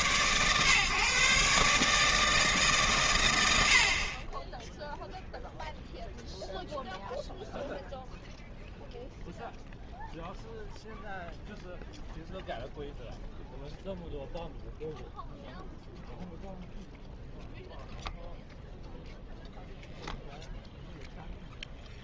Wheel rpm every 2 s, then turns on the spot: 130, 130, 0, 0, 0, 0, 0, 0, 0, 0, 0.
none